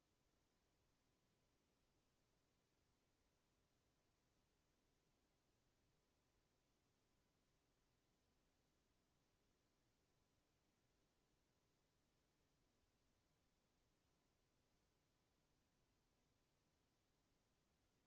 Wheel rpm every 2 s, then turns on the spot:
0, 0, 0, 0, 0, 0, 0, 0, 0.
none